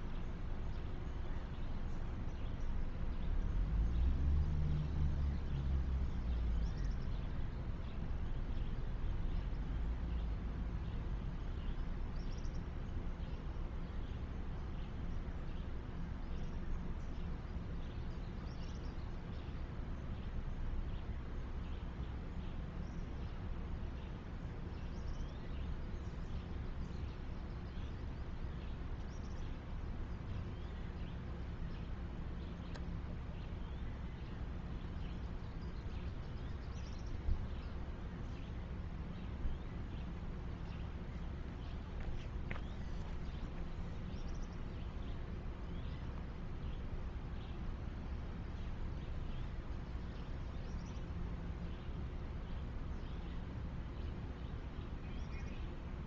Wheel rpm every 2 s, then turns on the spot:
0, 0, 0, 0, 0, 0, 0, 0, 0, 0, 0, 0, 0, 0, 0, 0, 0, 0, 0, 0, 0, 0, 0, 0, 0, 0, 0, 0.
none